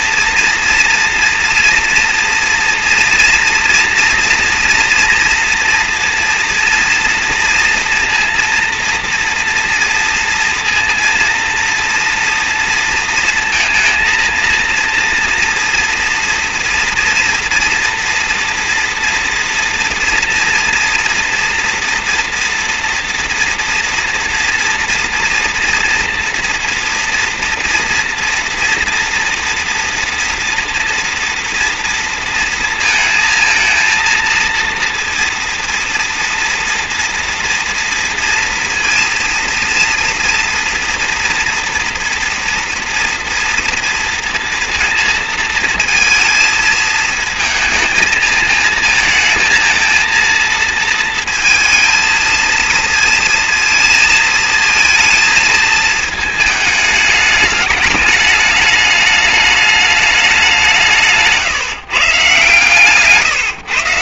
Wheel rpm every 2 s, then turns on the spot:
230, 230, 230, 240, 230, 230, 230, 230, 240, 230, 230, 230, 230, 230, 230, 240, 230, 230, 230, 230, 230, 230, 230, 220, 230, 230, 230, 230, 220, 210, 190, 130.
none